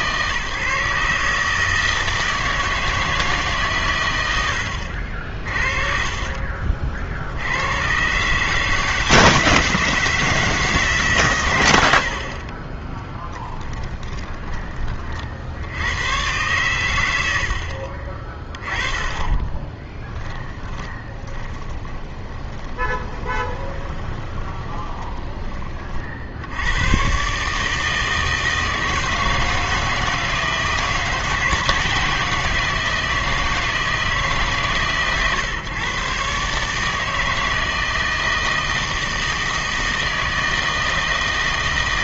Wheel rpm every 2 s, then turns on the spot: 140, 160, 80, 50, 150, 160, 20, 20, 120, 20, 20, 20, 20, 100, 160, 170, 170, 140, 150, 160, 160.
12-14 20-26